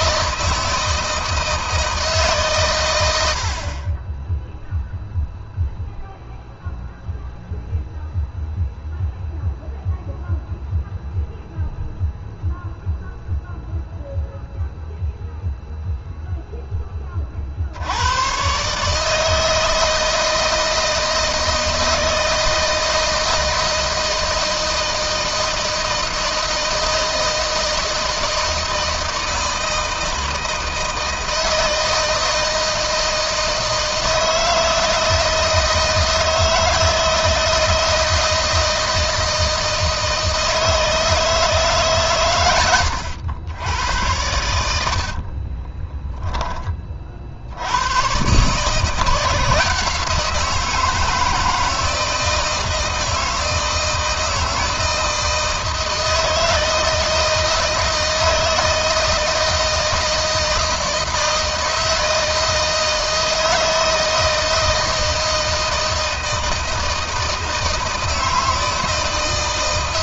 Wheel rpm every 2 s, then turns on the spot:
160, 100, 0, 0, 0, 0, 0, 0, 20, 150, 160, 160, 160, 160, 160, 160, 160, 160, 160, 160, 160, 100, 80, 30, 160, 160, 160, 160, 160, 160, 160, 160, 160, 160, 160.
44-46